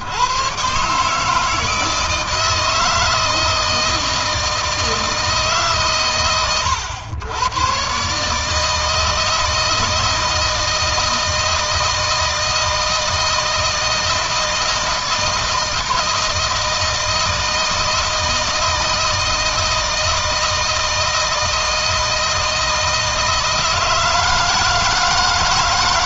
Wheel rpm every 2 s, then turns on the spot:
150, 160, 160, 100, 160, 160, 160, 160, 160, 160, 160, 160, 160.
none